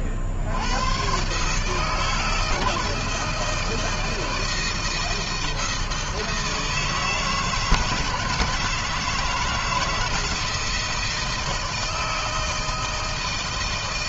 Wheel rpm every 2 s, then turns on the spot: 70, 160, 160, 160, 160, 160, 160.
none